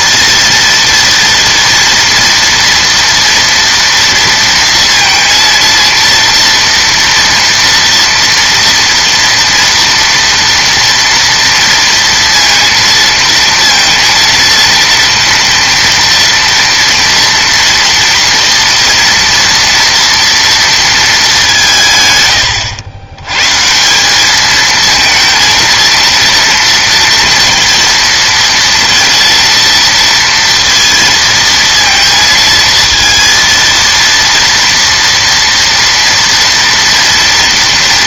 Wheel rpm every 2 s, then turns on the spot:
230, 230, 230, 230, 230, 230, 230, 230, 230, 230, 230, 90, 220, 240, 230, 230, 230, 230, 230.
none